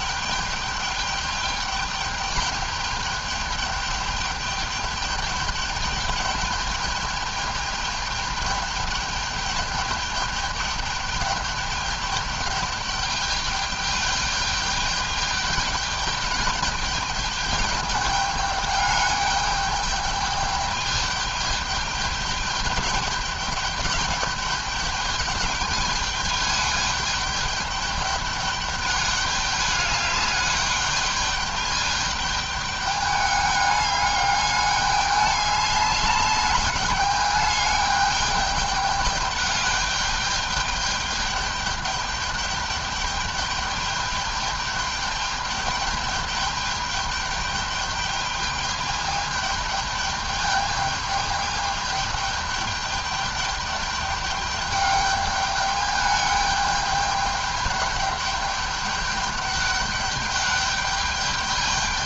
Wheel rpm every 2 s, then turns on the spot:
210, 210, 210, 210, 210, 210, 210, 210, 210, 210, 210, 210, 210, 210, 210, 210, 210, 210, 200, 210, 210, 210, 210, 210, 210, 210, 210, 210, 200, 210, 210.
none